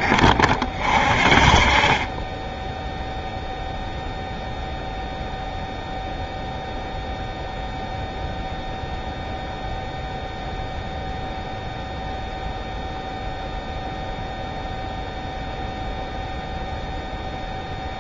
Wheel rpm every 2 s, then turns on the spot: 30, 10, 0, 0, 0, 0, 0, 0, 0.
none